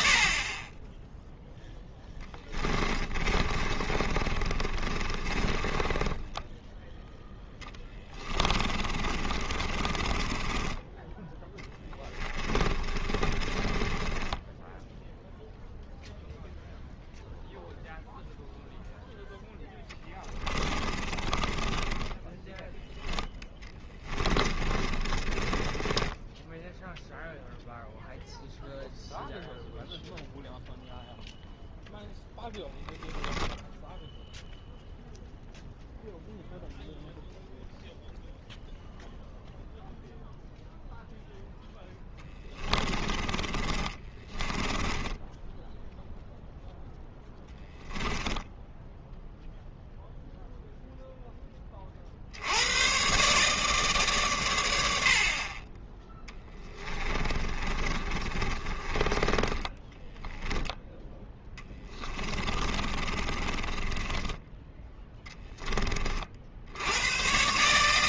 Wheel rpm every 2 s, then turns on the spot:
20, 20, 30, 10, 30, 20, 20, 10, 0, 0, 20, 10, 20, 10, 0, 0, 0, 0, 0, 0, 0, 20, 10, 0, 10, 0, 90, 90, 10, 30, 10, 30, 10, 80.
2-6 8-16 20-26 42-46 48-50 56-60 62-64